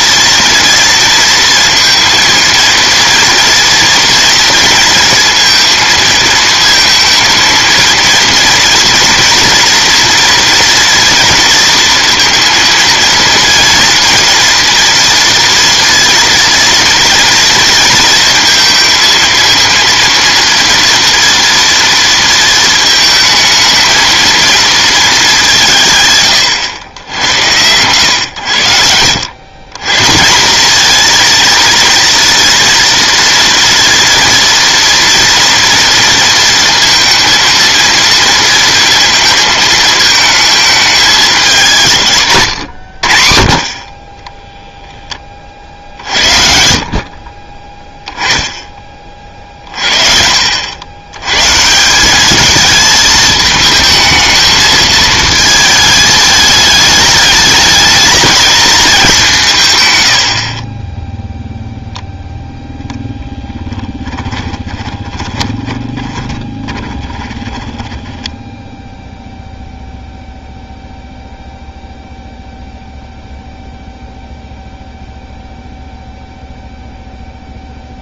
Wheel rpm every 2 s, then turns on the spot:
230, 220, 230, 230, 230, 230, 230, 230, 230, 230, 230, 220, 220, 100, 90, 210, 230, 230, 230, 220, 220, 100, 0, 70, 10, 80, 220, 220, 210, 220, 40, 0, 20, 20, 0, 0, 0, 0, 0.
42-44 64-68